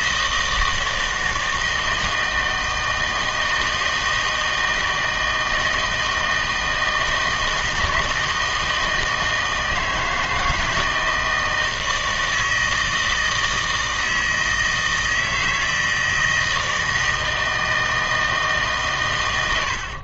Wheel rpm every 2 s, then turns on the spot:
160, 160, 160, 160, 160, 160, 160, 160, 160, 150.
none